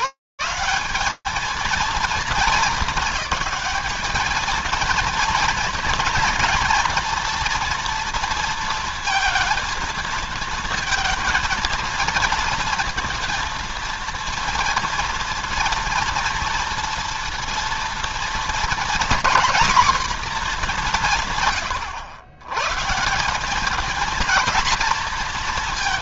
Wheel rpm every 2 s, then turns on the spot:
200, 220, 230, 240, 230, 230, 230, 230, 240, 240, 200, 130, 230.
none